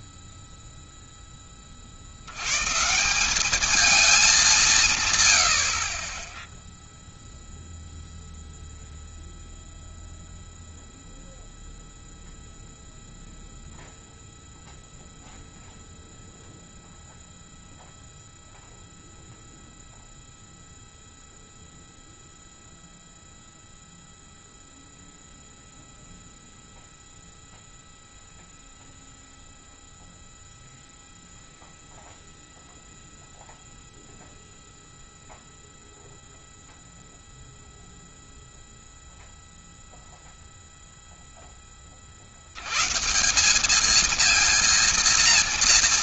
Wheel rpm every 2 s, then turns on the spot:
0, 120, 180, 10, 0, 0, 0, 0, 0, 0, 0, 0, 0, 0, 0, 0, 0, 0, 0, 0, 0, 110, 230.
none